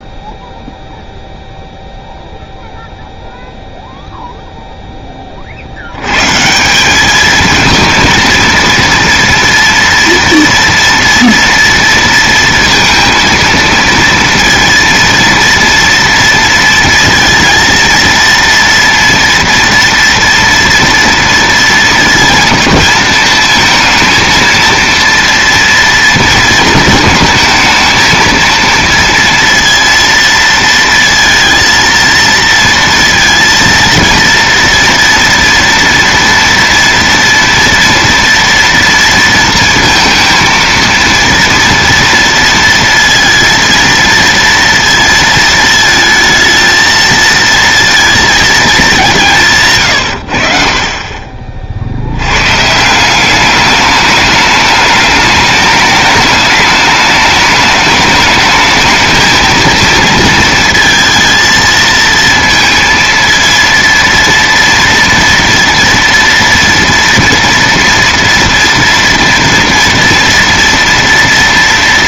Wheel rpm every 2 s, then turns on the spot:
0, 0, 10, 210, 230, 230, 230, 230, 230, 230, 230, 220, 230, 220, 230, 230, 230, 230, 230, 230, 230, 230, 230, 220, 200, 40, 190, 210, 210, 220, 230, 230, 230, 230, 230, 230.
50-52